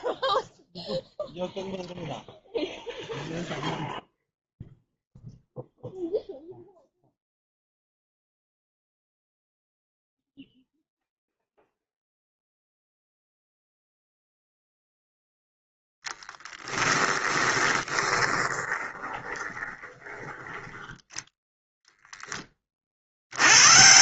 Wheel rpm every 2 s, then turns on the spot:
0, 0, 0, 0, 0, 0, 0, 0, 10, 20, 10, 30.
16-20